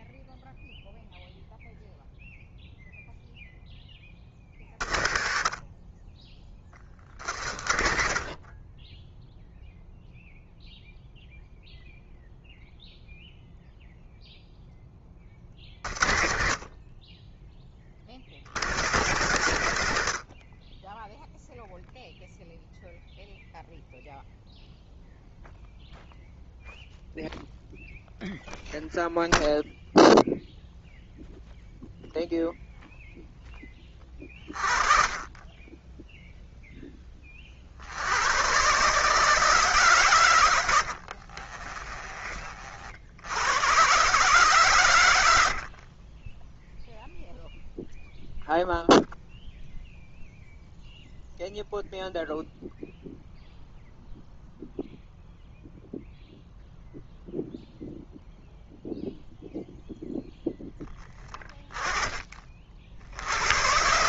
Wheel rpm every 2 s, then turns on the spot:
0, 0, 50, 30, 30, 0, 0, 10, 40, 100, 40, 0, 0, 0, 0, 0, 0, 40, 0, 130, 90, 40, 120, 0, 0, 0, 0, 0, 0, 0, 10, 40.
40-42